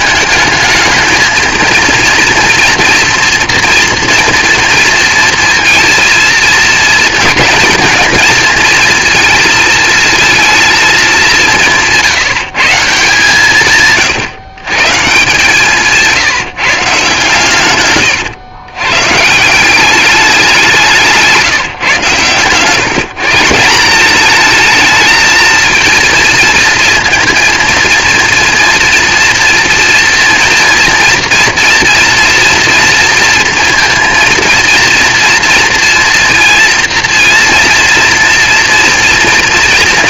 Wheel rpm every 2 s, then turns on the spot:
210, 230, 230, 230, 230, 230, 170, 140, 150, 130, 190, 130, 220, 230, 230, 230, 230, 230, 230, 230.
none